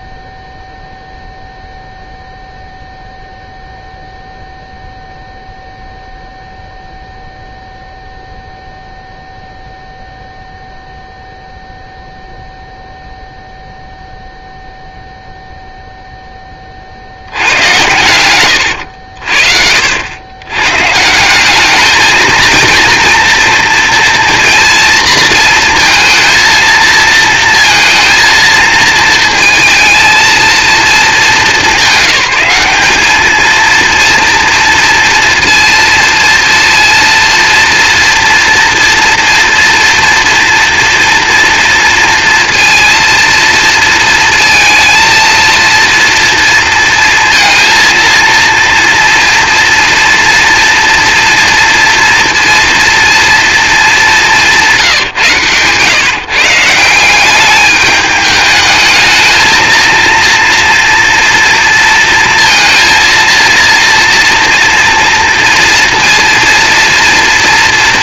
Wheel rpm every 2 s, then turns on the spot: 0, 0, 0, 0, 0, 0, 0, 0, 30, 80, 140, 230, 230, 230, 230, 230, 200, 230, 230, 230, 230, 240, 230, 230, 230, 230, 230, 160, 160, 220, 230, 230, 230, 230.
54-56